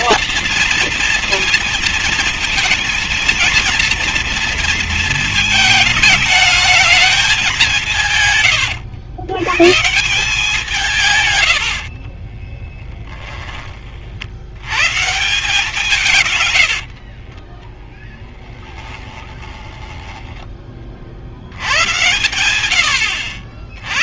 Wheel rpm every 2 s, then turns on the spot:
230, 230, 230, 220, 140, 170, 40, 80, 110, 10, 10, 100.
12-14 16-20